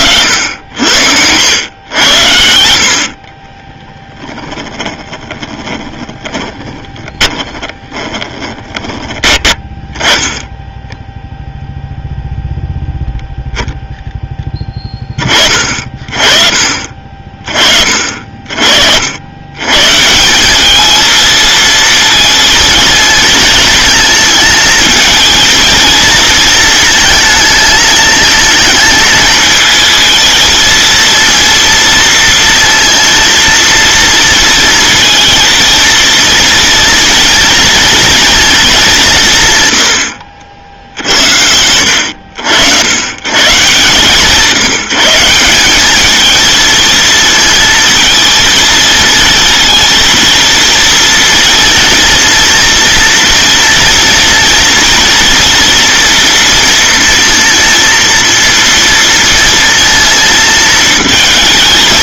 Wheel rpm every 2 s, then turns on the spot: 80, 70, 20, 20, 20, 10, 0, 10, 40, 50, 200, 220, 220, 230, 220, 220, 230, 230, 230, 220, 70, 90, 170, 220, 220, 230, 230, 230, 230, 240, 220.
4-10